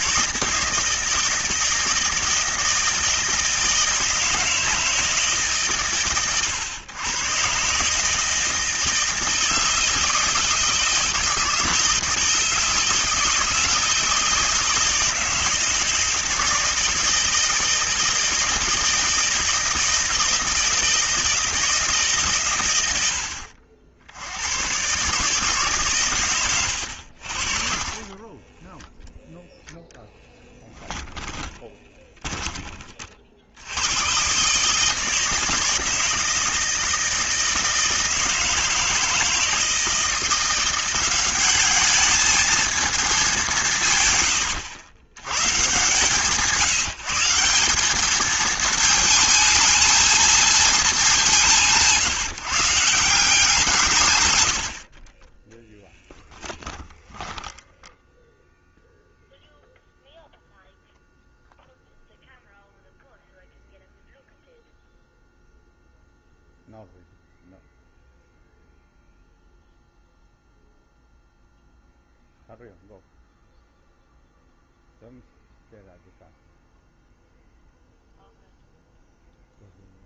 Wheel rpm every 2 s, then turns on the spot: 160, 160, 160, 120, 160, 160, 160, 160, 160, 160, 160, 110, 120, 90, 10, 10, 30, 150, 160, 160, 180, 230, 90, 160, 220, 220, 160, 60, 10, 0, 0, 0, 0, 0, 0, 0, 0, 0, 0, 0.
26-32 56-58